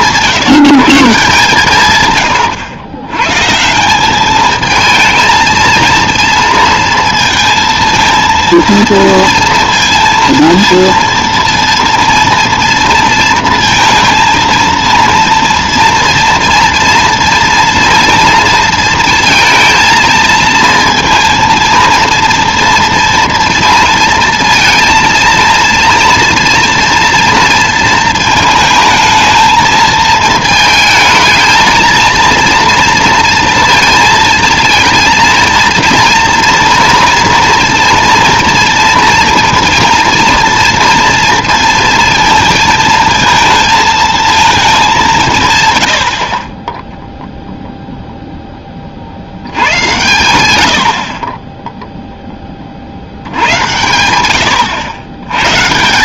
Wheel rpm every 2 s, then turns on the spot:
170, 100, 220, 230, 230, 230, 230, 230, 230, 230, 230, 230, 230, 240, 220, 220, 230, 230, 240, 230, 230, 220, 220, 20, 20, 90, 40, 100.
none